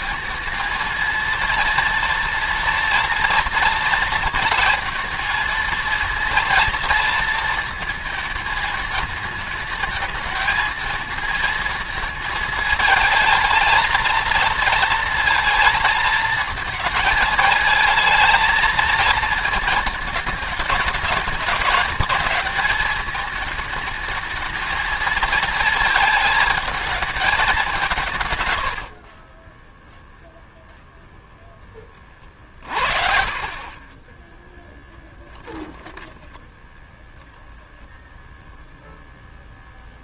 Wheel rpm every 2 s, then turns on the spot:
230, 230, 230, 230, 220, 220, 220, 230, 220, 230, 220, 220, 230, 220, 60, 0, 50, 0, 0, 0.
none